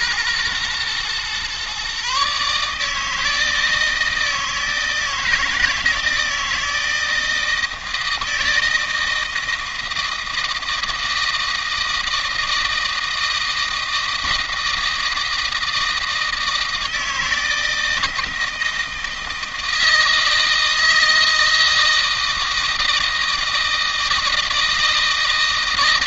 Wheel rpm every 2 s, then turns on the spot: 120, 150, 160, 160, 160, 160, 160, 160, 160, 160, 160, 160, 160.
none